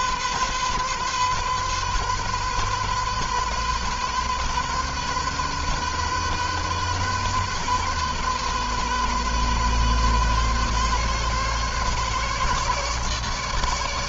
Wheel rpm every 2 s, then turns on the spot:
130, 130, 130, 130, 130, 130, 150.
none